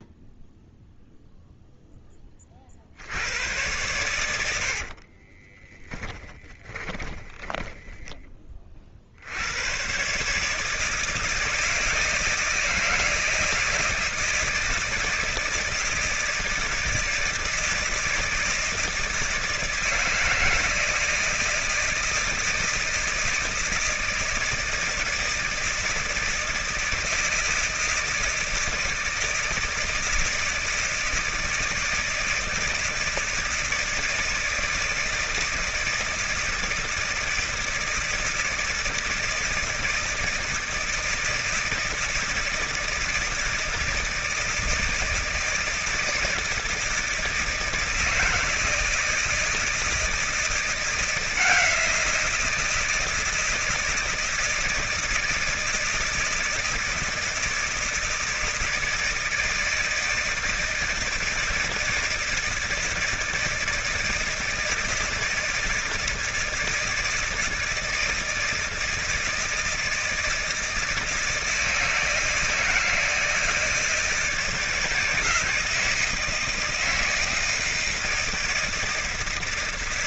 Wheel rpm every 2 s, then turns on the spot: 0, 40, 80, 20, 30, 160, 160, 160, 160, 160, 160, 160, 160, 160, 160, 160, 160, 160, 160, 160, 160, 160, 160, 160, 160, 170, 170, 160, 160, 160, 170, 160, 160, 160, 160, 160, 160, 160, 160, 160.
4-8